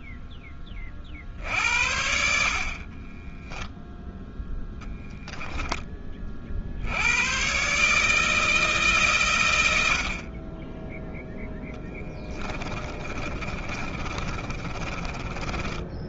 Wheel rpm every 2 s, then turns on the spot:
20, 50, 0, 50, 150, 40, 30, 30.
2-4 12-16